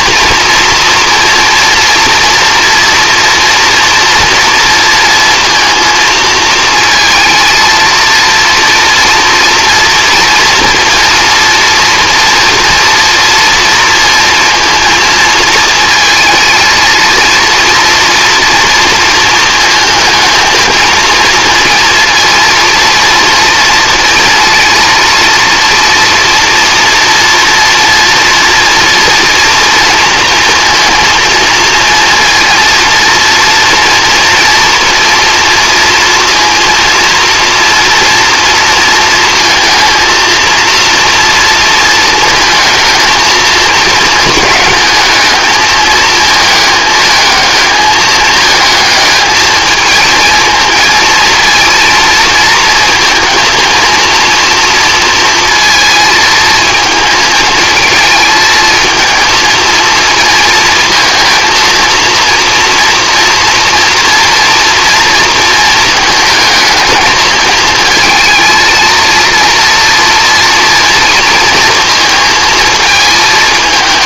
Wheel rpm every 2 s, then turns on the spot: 230, 240, 230, 220, 230, 230, 240, 230, 230, 230, 220, 230, 230, 230, 240, 230, 230, 240, 230, 230, 230, 230, 210, 220, 220, 230, 230, 230, 230, 220, 230, 230, 230, 220, 230, 230, 220.
none